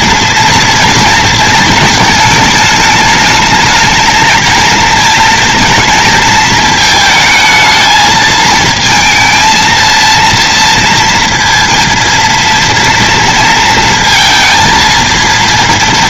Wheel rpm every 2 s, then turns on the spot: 230, 220, 220, 220, 220, 230, 230, 230.
none